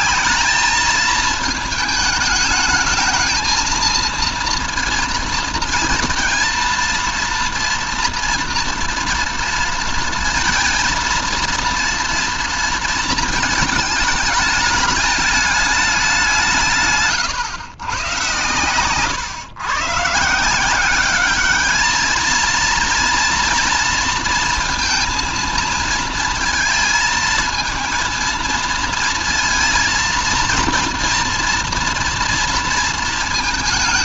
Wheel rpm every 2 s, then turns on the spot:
210, 220, 230, 230, 240, 230, 230, 210, 170, 120, 170, 230, 230, 220, 230, 230, 230.
none